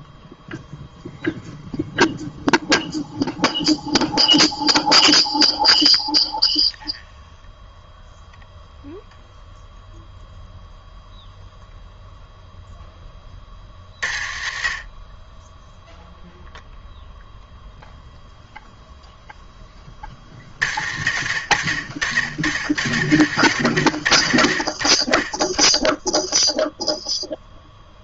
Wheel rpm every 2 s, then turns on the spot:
0, 0, 0, 0, 0, 0, 10, 60, 0, 0, 80, 80, 30, 0.
none